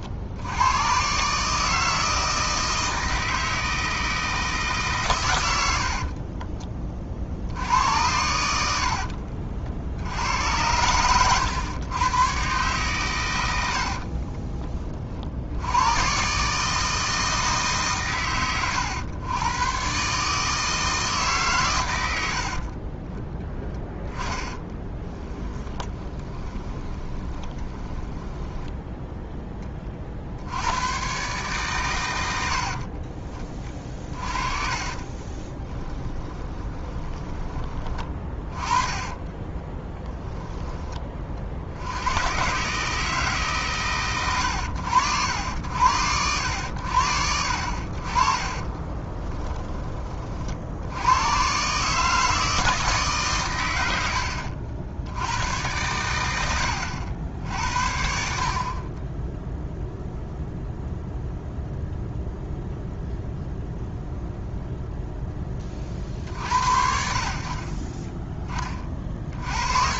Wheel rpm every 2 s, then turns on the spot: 110, 160, 140, 30, 70, 100, 120, 30, 160, 110, 160, 30, 10, 20, 10, 100, 50, 30, 10, 30, 20, 150, 90, 80, 20, 80, 150, 80, 80, 30, 0, 0, 0, 60, 30.
8-10 24-30 34-40 48-50